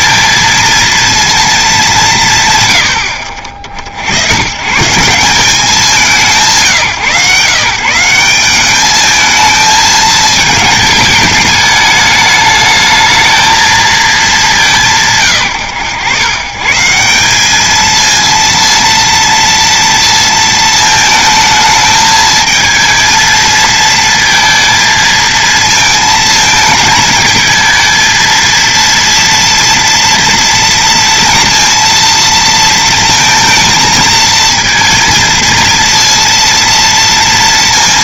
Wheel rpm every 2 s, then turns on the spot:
230, 120, 140, 170, 200, 220, 210, 180, 130, 230, 220, 230, 220, 220, 230, 230, 230, 230, 230.
none